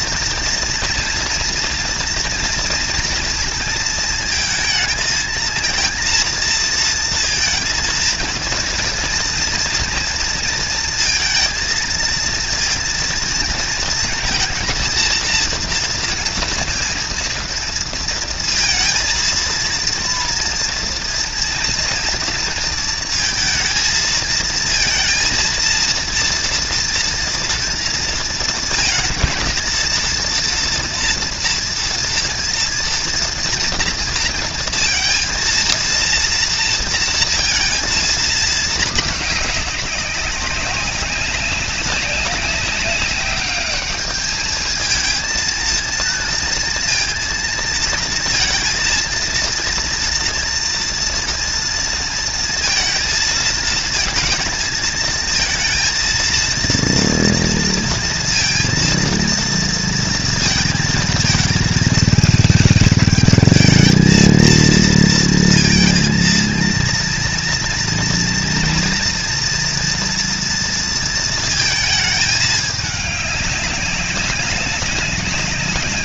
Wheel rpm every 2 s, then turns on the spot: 230, 230, 220, 230, 230, 230, 220, 230, 230, 230, 230, 230, 230, 230, 230, 230, 230, 230, 230, 220, 190, 190, 220, 230, 230, 240, 230, 230, 230, 230, 230, 220, 230, 230, 230, 230, 210, 200.
none